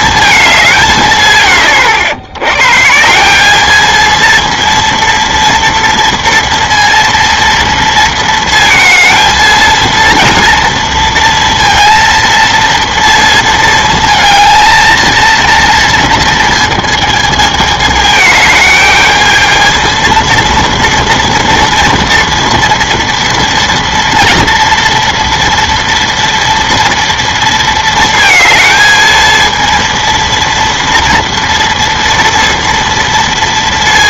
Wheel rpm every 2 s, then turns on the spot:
190, 130, 230, 230, 220, 230, 230, 230, 230, 210, 230, 230, 230, 230, 220, 230, 230.
none